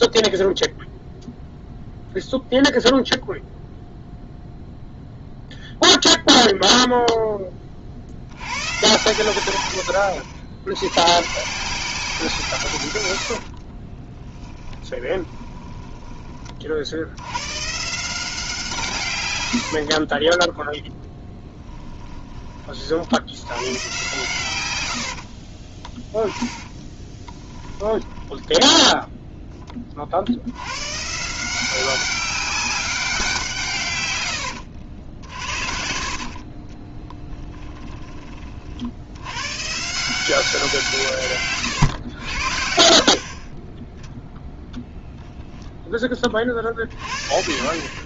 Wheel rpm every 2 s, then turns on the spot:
0, 0, 0, 0, 110, 90, 140, 10, 40, 160, 10, 30, 100, 10, 10, 100, 200, 80, 40, 50, 170, 60, 0, 30.
14-16 20-22 26-28 34-38